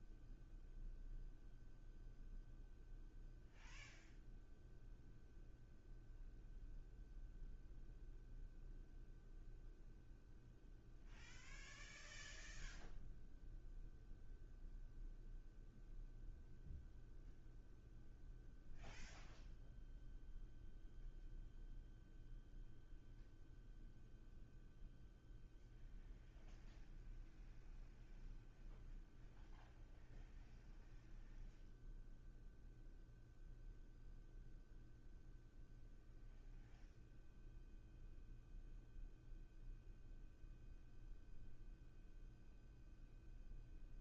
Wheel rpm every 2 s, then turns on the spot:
0, 0, 0, 0, 0, 0, 0, 0, 0, 0, 0, 0, 0, 0, 0, 0, 0, 0, 0, 0, 0, 0.
none